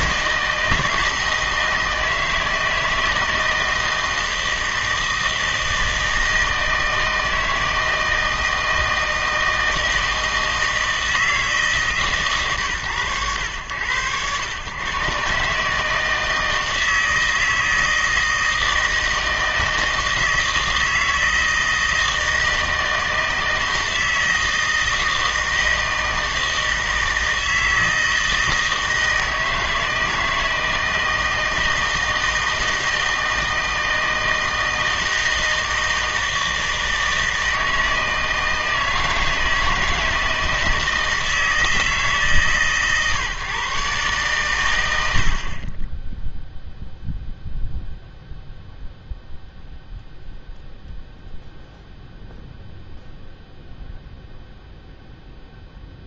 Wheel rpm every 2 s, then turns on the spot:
160, 160, 160, 160, 160, 160, 130, 110, 160, 160, 160, 160, 160, 160, 160, 160, 160, 160, 160, 160, 160, 130, 100, 0, 0, 0, 0, 0.
none